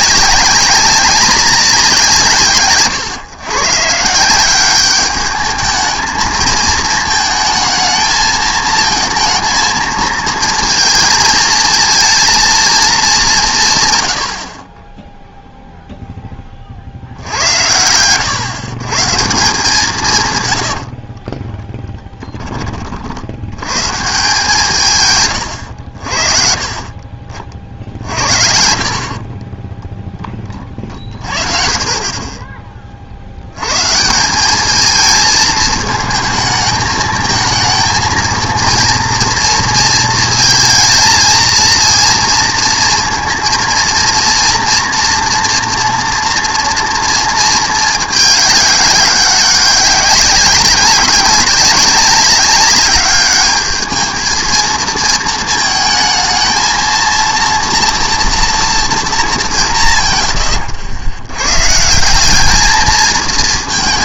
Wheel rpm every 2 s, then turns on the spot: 200, 140, 190, 220, 220, 230, 230, 50, 40, 130, 90, 30, 160, 40, 60, 30, 20, 200, 220, 230, 230, 230, 230, 230, 200, 190, 200, 220, 220, 240, 100, 210.
none